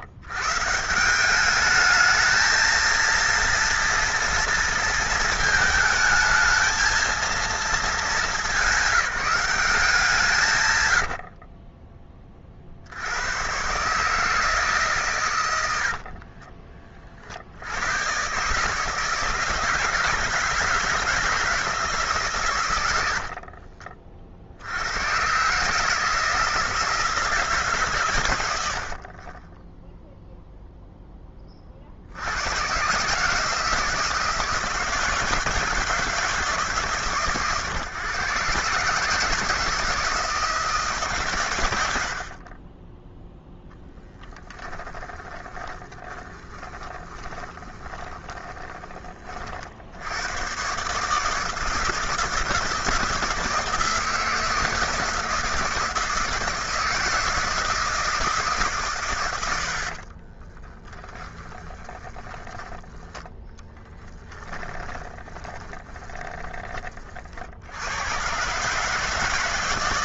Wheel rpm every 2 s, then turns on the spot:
110, 220, 230, 220, 210, 140, 50, 150, 30, 140, 160, 140, 50, 170, 100, 0, 100, 170, 160, 140, 160, 40, 10, 20, 20, 110, 170, 160, 160, 150, 30, 20, 20, 30, 120.
16-18 44-50 60-68